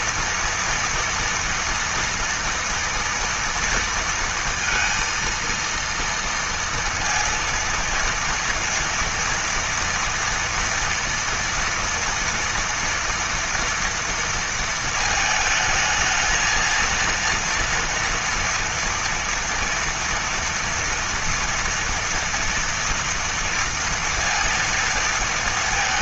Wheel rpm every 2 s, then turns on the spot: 230, 230, 230, 230, 230, 240, 230, 230, 230, 230, 230, 230, 230.
none